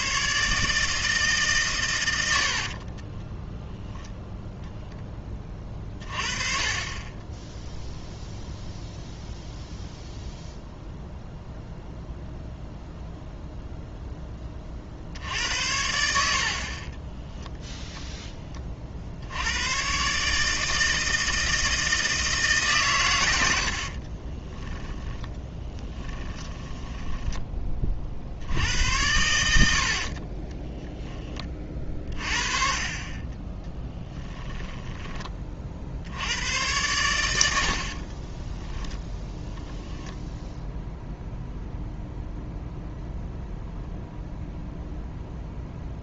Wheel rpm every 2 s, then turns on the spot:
150, 50, 0, 30, 0, 0, 0, 40, 40, 30, 160, 150, 10, 10, 80, 20, 40, 30, 100, 10, 0, 0, 0.
2-4 24-28 30-32 34-36 38-40